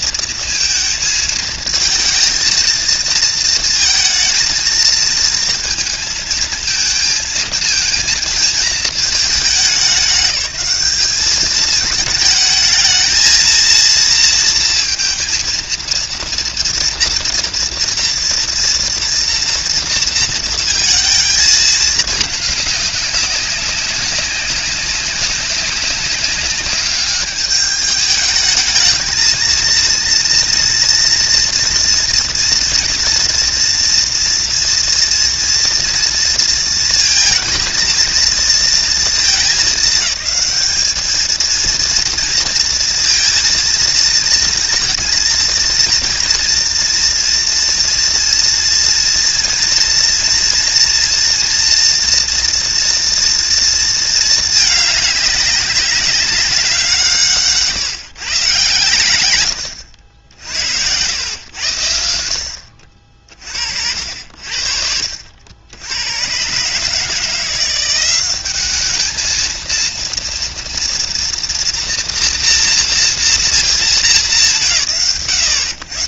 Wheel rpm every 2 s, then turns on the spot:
230, 230, 230, 220, 230, 210, 220, 230, 230, 230, 230, 200, 200, 200, 210, 230, 230, 230, 230, 230, 210, 230, 220, 240, 230, 230, 240, 220, 180, 140, 90, 70, 70, 130, 210, 230, 230, 150.
62-64